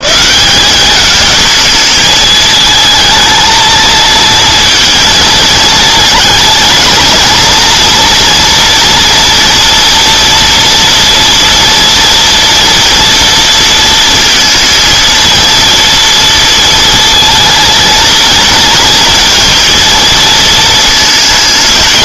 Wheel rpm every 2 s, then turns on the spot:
200, 220, 230, 220, 240, 230, 230, 230, 230, 230, 220.
none